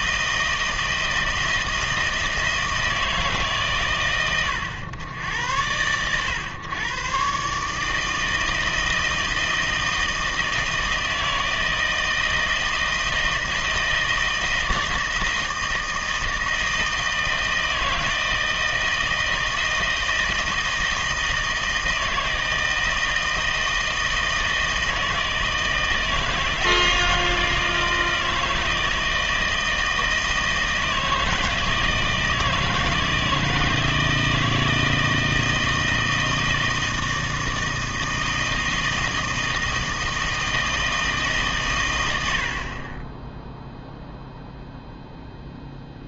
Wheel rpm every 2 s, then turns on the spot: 160, 160, 100, 120, 160, 160, 160, 160, 160, 160, 160, 160, 160, 160, 160, 160, 160, 160, 160, 160, 160, 40, 0.
none